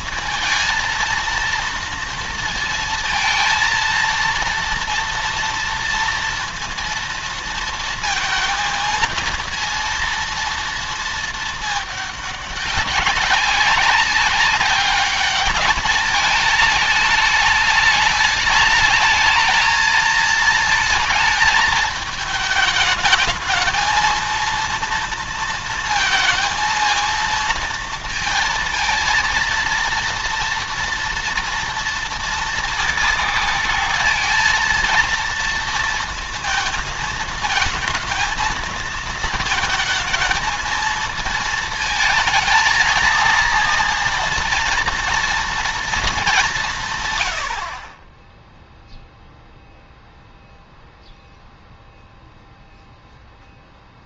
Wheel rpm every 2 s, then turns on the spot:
230, 230, 230, 230, 230, 230, 200, 200, 210, 210, 230, 220, 230, 230, 220, 230, 230, 230, 230, 220, 220, 220, 230, 190, 10, 0, 0.
none